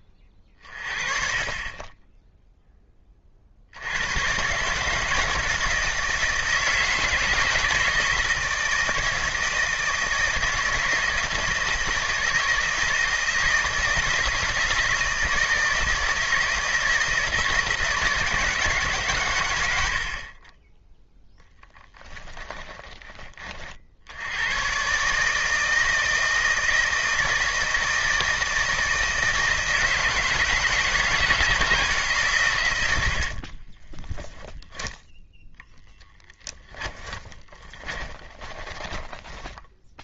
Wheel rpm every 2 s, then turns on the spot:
30, 10, 150, 160, 160, 170, 160, 160, 160, 150, 10, 20, 130, 160, 160, 160, 110, 0, 10, 10.
22-24 36-40